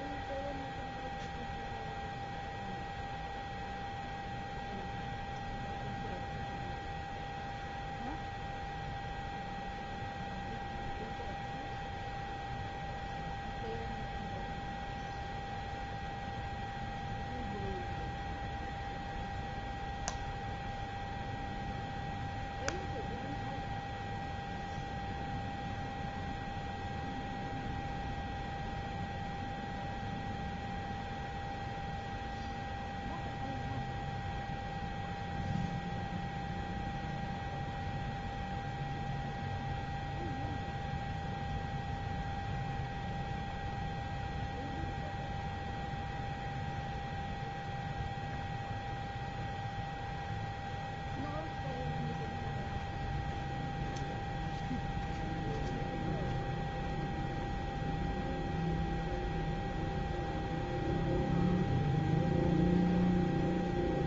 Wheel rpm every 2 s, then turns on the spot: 0, 0, 0, 0, 0, 0, 0, 0, 0, 0, 0, 0, 0, 0, 0, 0, 0, 0, 0, 0, 0, 0, 0, 0, 0, 0, 0, 0, 0, 0, 0, 0.
none